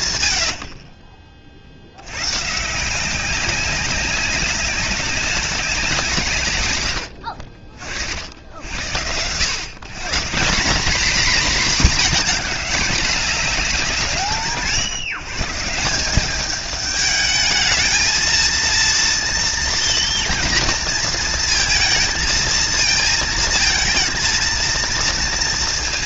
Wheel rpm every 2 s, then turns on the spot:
100, 150, 190, 100, 80, 210, 220, 150, 210, 230, 230, 220, 230.
none